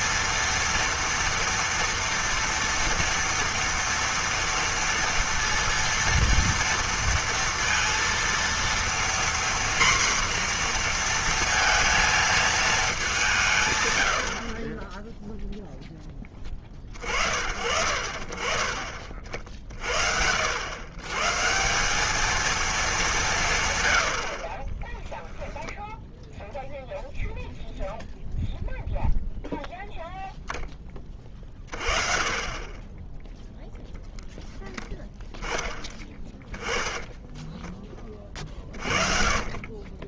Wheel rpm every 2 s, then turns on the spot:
230, 230, 230, 230, 230, 240, 220, 60, 20, 30, 70, 220, 70, 0, 0, 0, 20, 10, 10, 30.
none